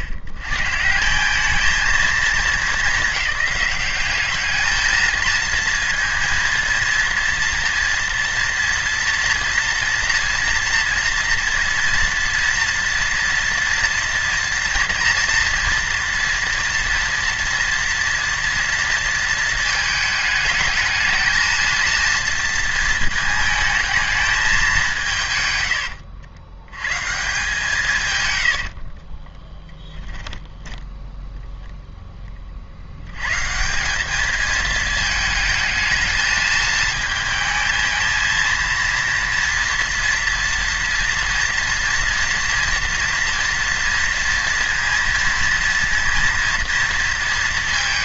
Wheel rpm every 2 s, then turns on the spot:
100, 220, 210, 230, 230, 240, 230, 230, 230, 230, 220, 230, 200, 110, 90, 0, 40, 220, 220, 220, 230, 230, 230, 230.
28-30